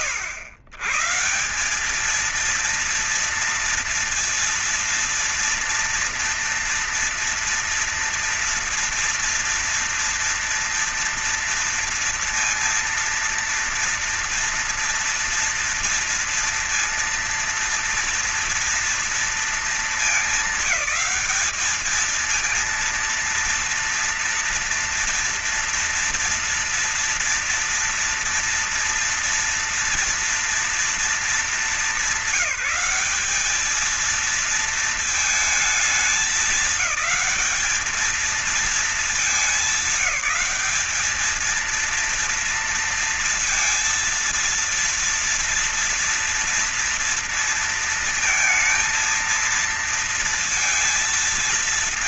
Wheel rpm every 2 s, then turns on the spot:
130, 230, 230, 230, 230, 230, 230, 230, 230, 230, 220, 230, 240, 230, 230, 230, 210, 220, 210, 220, 210, 230, 230, 230, 230, 230.
none